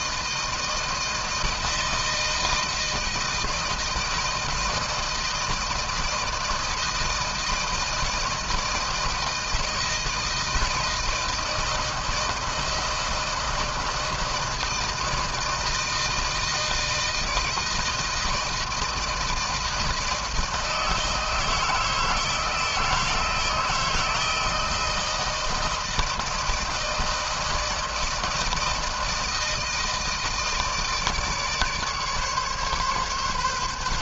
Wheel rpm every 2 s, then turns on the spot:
160, 160, 160, 160, 160, 160, 160, 160, 160, 160, 160, 160, 160, 160, 160, 160, 140.
none